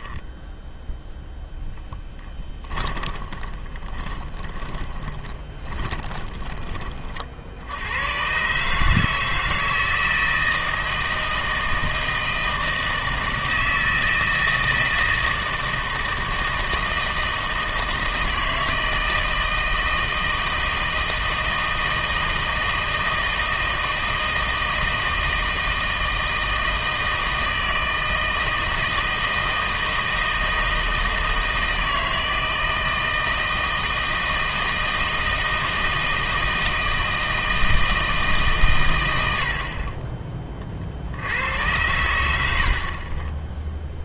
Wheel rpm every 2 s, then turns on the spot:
0, 10, 20, 30, 140, 160, 160, 160, 160, 160, 160, 160, 160, 160, 160, 160, 160, 160, 160, 140, 30, 80.
2-8 42-44